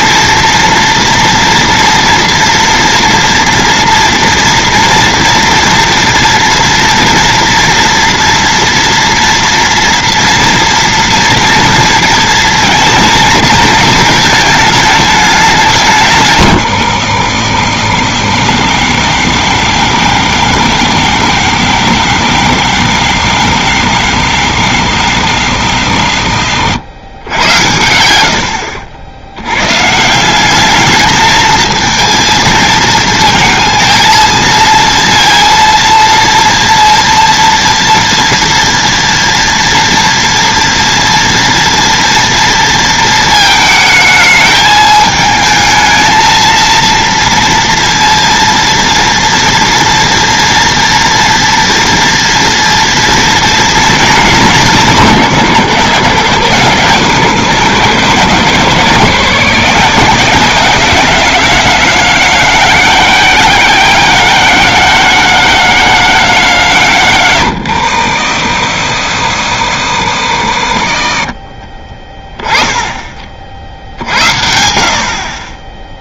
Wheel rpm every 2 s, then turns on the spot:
230, 240, 230, 230, 230, 230, 230, 220, 130, 80, 90, 90, 90, 80, 70, 200, 220, 230, 230, 230, 230, 230, 220, 230, 230, 230, 230, 200, 140, 150, 180, 200, 200, 170, 70, 60, 30, 70.
26-28